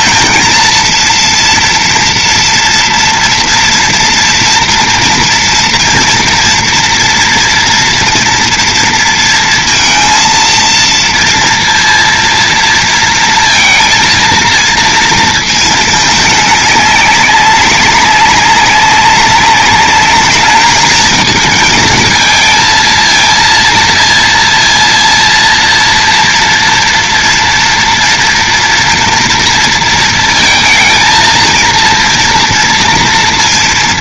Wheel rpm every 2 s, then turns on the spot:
230, 240, 230, 230, 230, 230, 230, 230, 200, 190, 210, 220, 230, 230, 230, 230, 230.
none